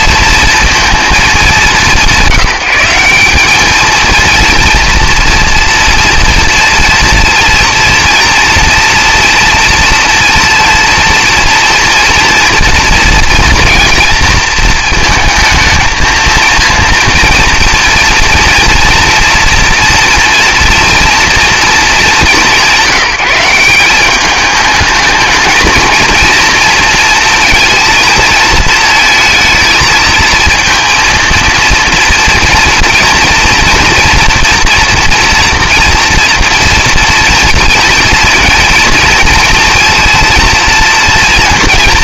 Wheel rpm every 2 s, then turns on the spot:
230, 180, 230, 230, 230, 230, 230, 230, 230, 230, 240, 170, 210, 230, 220, 230, 230, 240, 230, 230, 230.
none